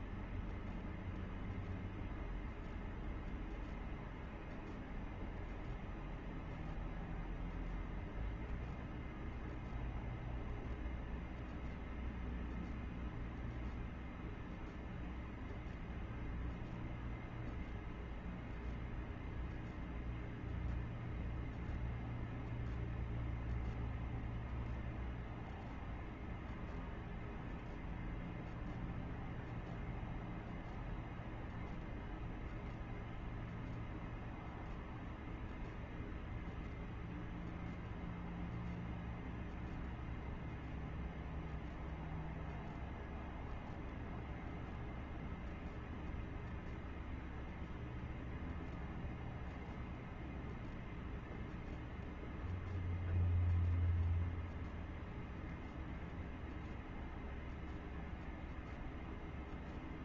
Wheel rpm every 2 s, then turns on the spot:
0, 0, 0, 0, 0, 0, 0, 0, 0, 0, 0, 0, 0, 0, 0, 0, 0, 0, 0, 0, 0, 0, 0, 0, 0, 0, 0, 0, 0, 0.
none